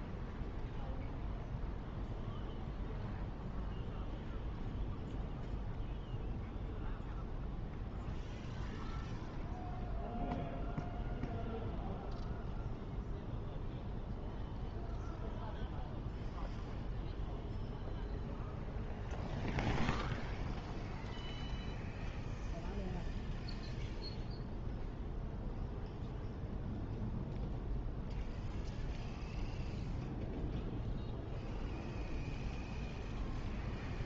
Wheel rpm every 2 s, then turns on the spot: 0, 0, 0, 0, 0, 0, 0, 0, 0, 0, 0, 0, 0, 0, 0, 0, 0.
none